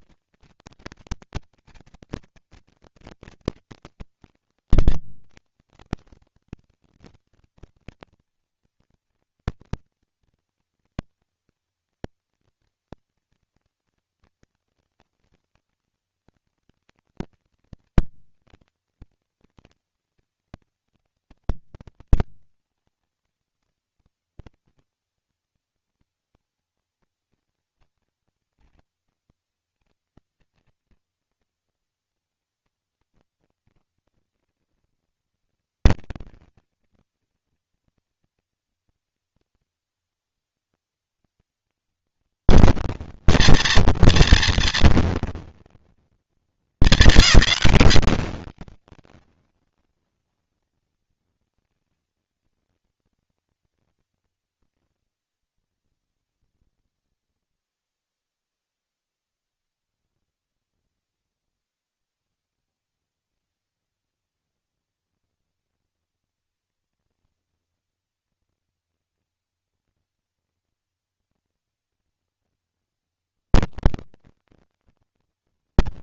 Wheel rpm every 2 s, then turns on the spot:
230, 230, 230, 230, 230, 230, 230, 230, 230, 230, 210, 230, 230, 230, 230, 230, 230, 230, 230, 230, 230, 230, 230, 210, 220, 230, 230, 80, 20, 10, 50, 220, 230, 240, 230, 220, 230, 230.
54-60